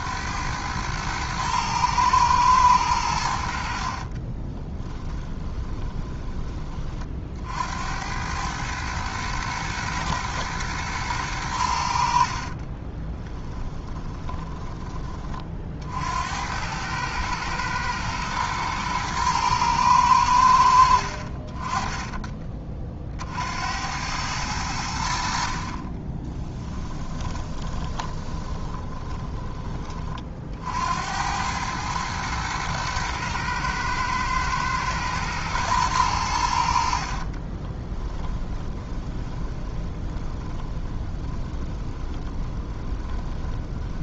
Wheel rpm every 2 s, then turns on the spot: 110, 100, 20, 30, 110, 110, 30, 20, 100, 110, 70, 40, 90, 10, 30, 70, 110, 110, 60, 20, 20, 20.
4-6 12-14 26-30 38-44